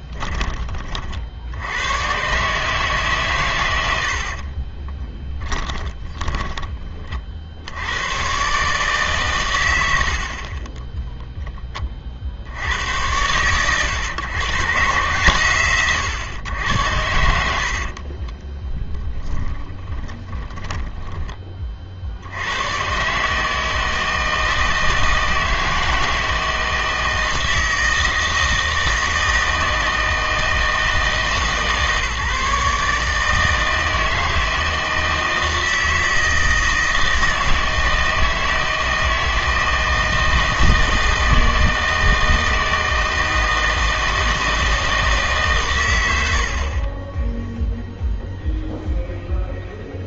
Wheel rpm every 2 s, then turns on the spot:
20, 150, 20, 20, 140, 40, 90, 130, 100, 20, 20, 110, 160, 160, 160, 160, 150, 160, 160, 160, 160, 160, 160, 40, 0.
4-6 18-22